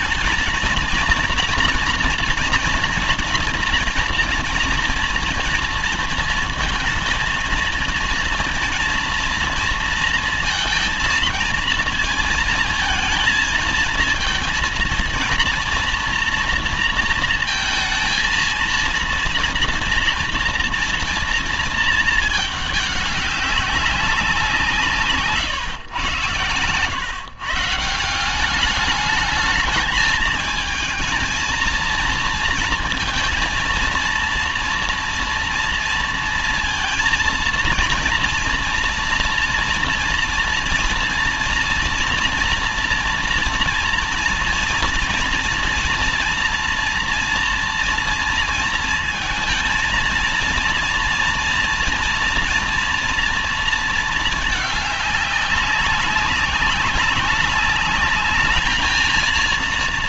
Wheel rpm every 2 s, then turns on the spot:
220, 230, 230, 230, 230, 230, 230, 230, 230, 230, 240, 210, 180, 130, 190, 220, 230, 230, 230, 230, 230, 240, 230, 240, 230, 230, 230, 210, 190, 220.
none